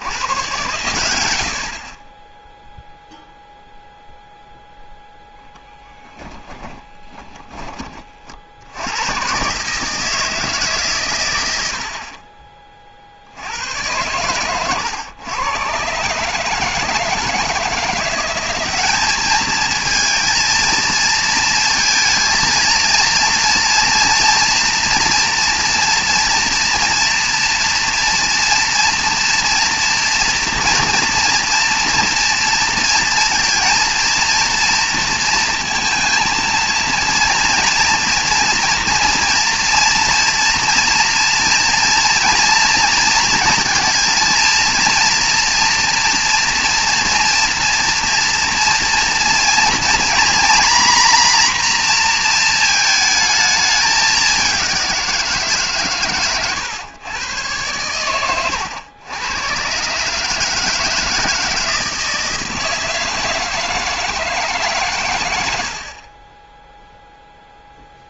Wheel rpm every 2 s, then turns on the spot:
110, 0, 0, 20, 70, 150, 30, 100, 150, 190, 230, 230, 240, 230, 230, 240, 230, 230, 230, 240, 230, 230, 230, 230, 230, 240, 220, 190, 130, 100, 160, 160, 140, 0.
6-8